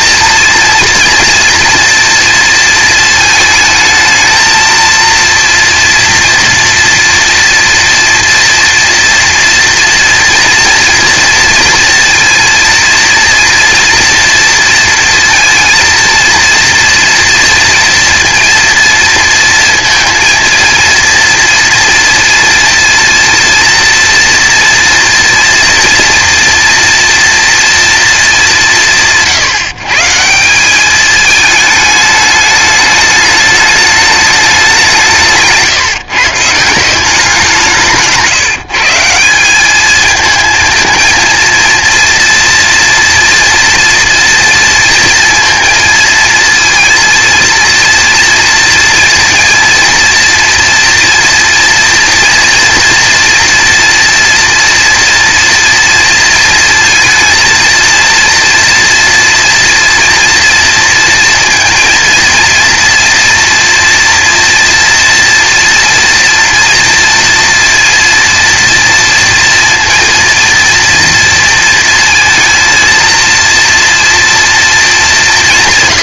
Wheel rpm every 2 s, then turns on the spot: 230, 230, 220, 230, 230, 230, 230, 230, 230, 230, 230, 230, 230, 230, 200, 190, 210, 200, 160, 160, 220, 230, 230, 220, 230, 240, 230, 230, 230, 230, 230, 230, 240, 230, 230, 240, 230, 220.
none